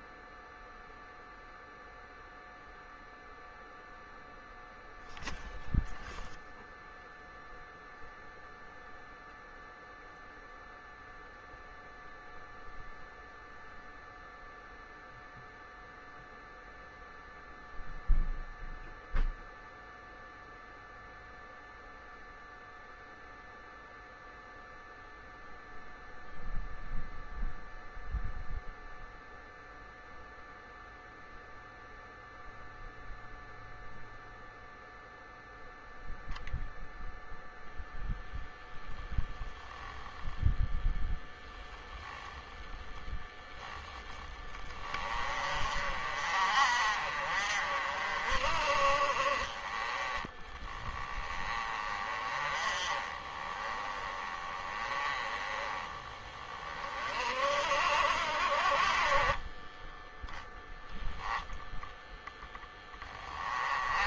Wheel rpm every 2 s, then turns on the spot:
0, 0, 0, 0, 0, 0, 0, 0, 0, 0, 0, 0, 0, 0, 0, 0, 0, 0, 0, 10, 10, 10, 20, 40, 40, 20, 30, 20, 30, 40, 0, 10.
none